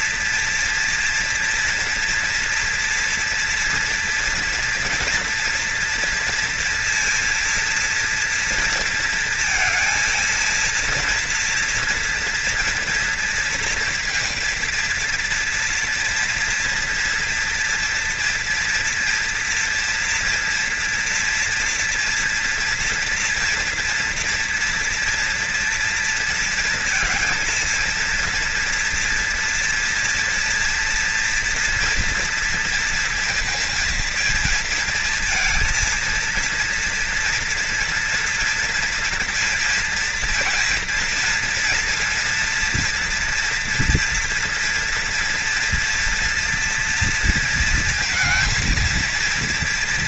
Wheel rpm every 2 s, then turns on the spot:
230, 230, 240, 230, 230, 230, 230, 230, 230, 230, 230, 240, 240, 230, 230, 230, 230, 230, 230, 230, 230, 230, 230, 230, 230.
none